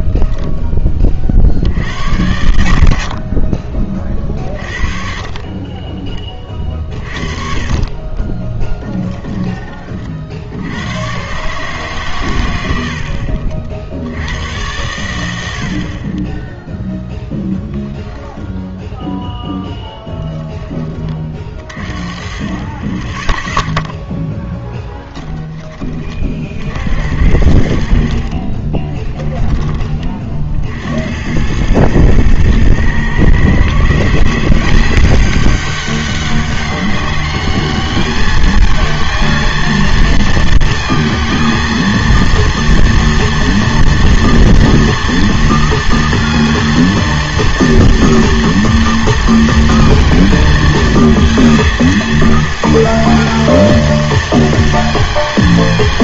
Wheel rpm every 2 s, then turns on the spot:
10, 80, 30, 30, 10, 80, 100, 100, 10, 10, 20, 40, 10, 60, 30, 60, 120, 170, 200, 220, 230, 230, 230, 230, 230, 230, 230, 230.
8-10 24-26 28-30